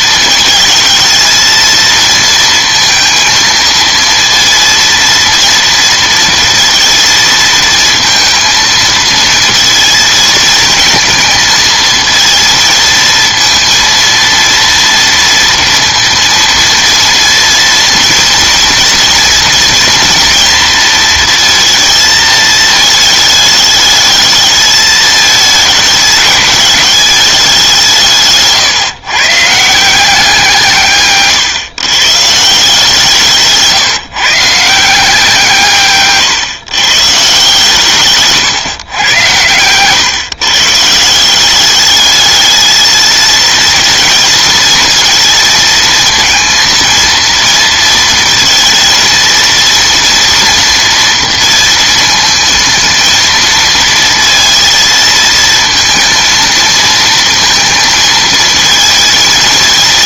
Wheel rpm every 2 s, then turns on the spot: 220, 220, 230, 230, 230, 230, 230, 230, 230, 230, 230, 220, 220, 210, 150, 170, 150, 140, 150, 130, 130, 210, 230, 230, 220, 230, 220, 230, 230, 230.
none